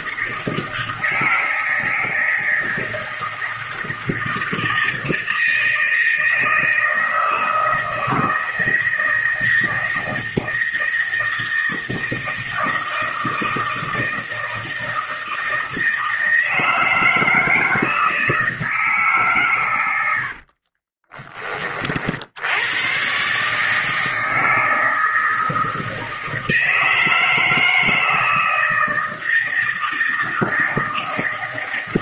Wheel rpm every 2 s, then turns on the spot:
160, 160, 160, 160, 160, 160, 170, 160, 160, 160, 50, 90, 160, 160, 160, 160.
20-22